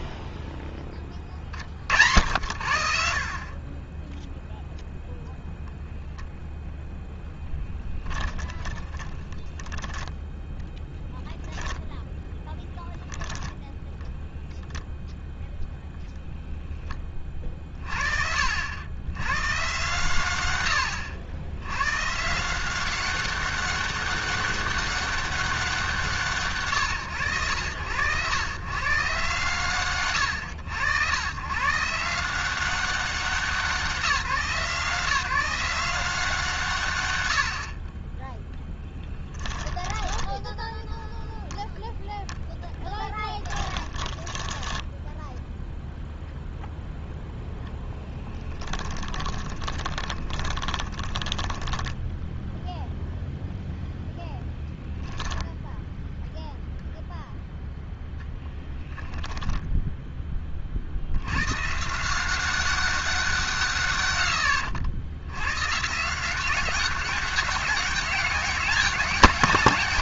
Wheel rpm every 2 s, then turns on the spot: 20, 80, 0, 0, 20, 10, 20, 0, 10, 60, 120, 170, 200, 130, 100, 100, 170, 160, 160, 0, 10, 0, 10, 0, 10, 20, 0, 0, 0, 10, 20, 190, 90, 180, 200.
8-10 12-14 40-42 44-46 48-52 58-60